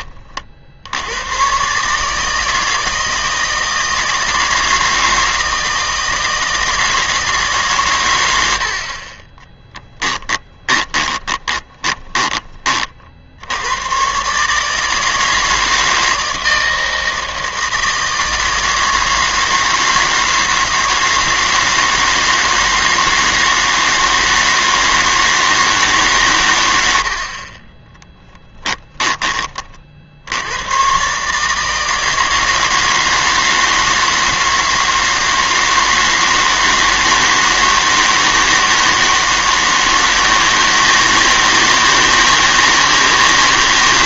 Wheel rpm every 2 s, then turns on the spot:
60, 160, 160, 160, 70, 10, 30, 150, 160, 160, 160, 160, 160, 100, 10, 100, 160, 160, 160, 160, 160, 160.
10-12 28-30